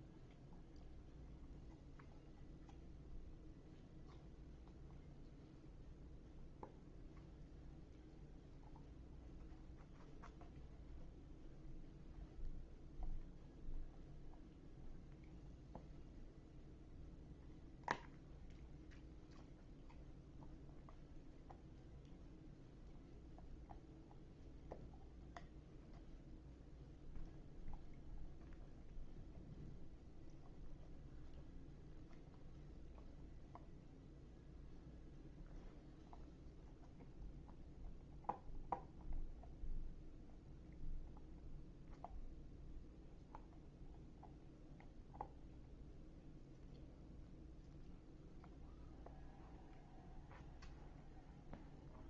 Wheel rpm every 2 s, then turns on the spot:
0, 0, 0, 0, 0, 0, 0, 0, 0, 0, 0, 0, 0, 0, 0, 0, 0, 0, 0, 0, 0, 0, 0, 0, 0, 0.
none